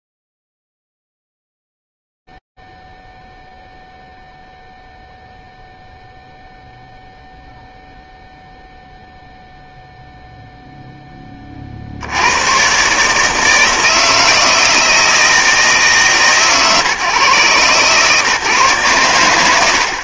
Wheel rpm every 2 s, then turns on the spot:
0, 0, 0, 0, 0, 0, 120, 160, 140, 150.
none